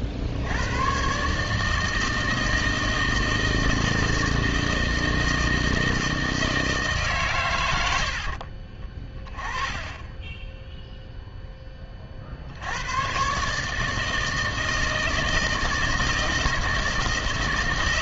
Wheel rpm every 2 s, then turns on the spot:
90, 160, 160, 160, 60, 10, 80, 160, 160.
8-10